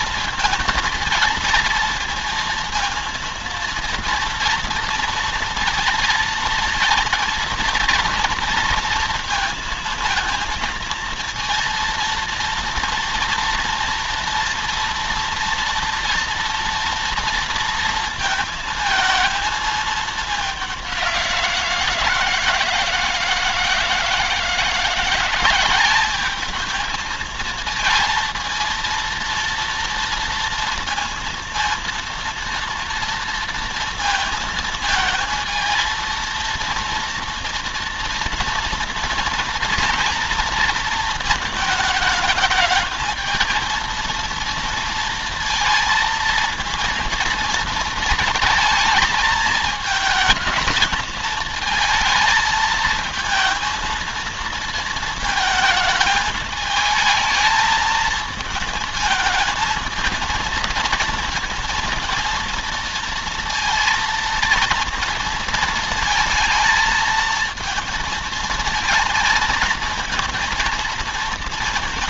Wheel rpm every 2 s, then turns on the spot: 230, 230, 230, 230, 230, 230, 230, 230, 230, 230, 190, 160, 170, 220, 230, 230, 230, 220, 230, 230, 230, 220, 230, 230, 220, 220, 220, 220, 220, 220, 230, 230, 230, 230, 230, 230.
none